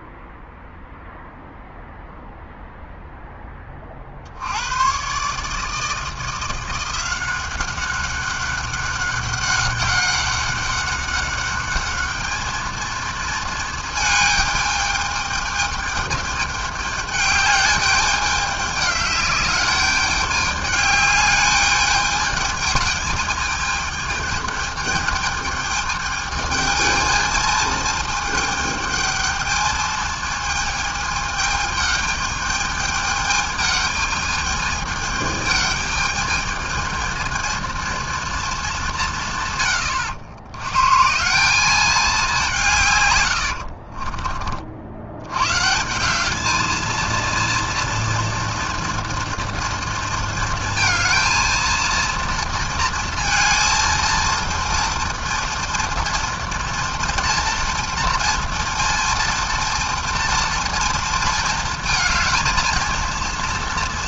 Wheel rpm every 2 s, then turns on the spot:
0, 0, 80, 170, 190, 200, 220, 220, 210, 210, 210, 210, 210, 210, 220, 220, 220, 220, 220, 220, 110, 190, 40, 200, 230, 230, 230, 230, 240, 230, 230, 220.
none